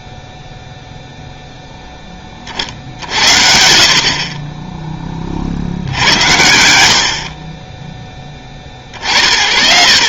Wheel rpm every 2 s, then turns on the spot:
0, 50, 10, 80, 30.
none